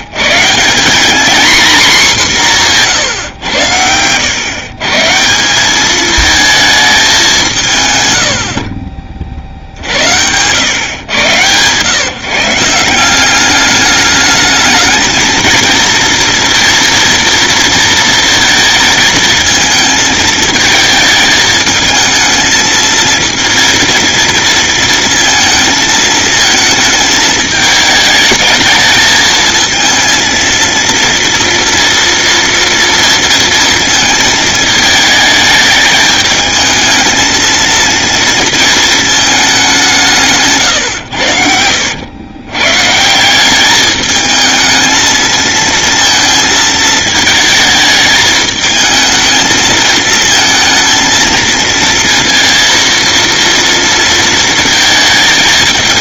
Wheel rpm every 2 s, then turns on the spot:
210, 140, 150, 210, 40, 120, 180, 220, 230, 220, 220, 220, 230, 220, 220, 230, 230, 220, 220, 220, 110, 150, 220, 220, 220, 230, 230, 220.
2-4